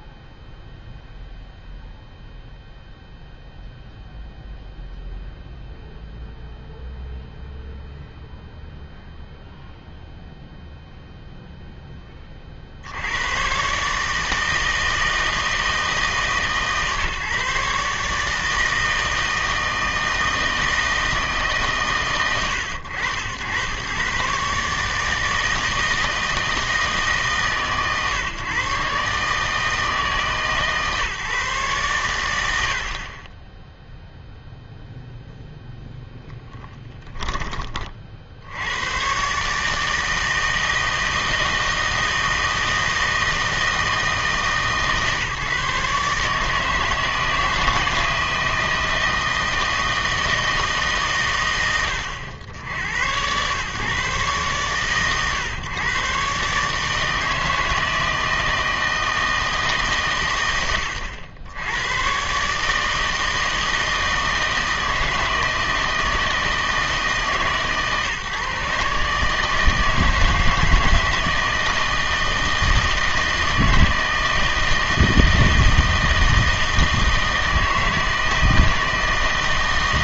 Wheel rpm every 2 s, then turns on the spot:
0, 0, 0, 0, 0, 0, 60, 160, 140, 160, 160, 100, 150, 160, 130, 140, 70, 0, 10, 90, 160, 160, 160, 160, 160, 160, 90, 130, 150, 160, 100, 150, 160, 160, 150, 160, 160, 160, 160, 160.
36-38